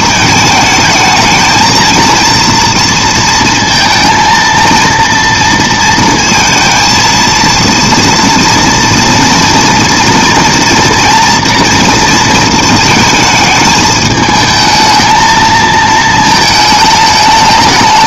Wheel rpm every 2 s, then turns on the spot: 220, 230, 230, 230, 230, 230, 220, 220, 220.
none